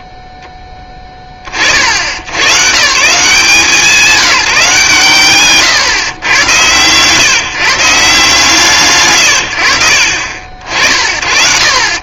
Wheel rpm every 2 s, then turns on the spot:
0, 140, 160, 110, 160, 50.
none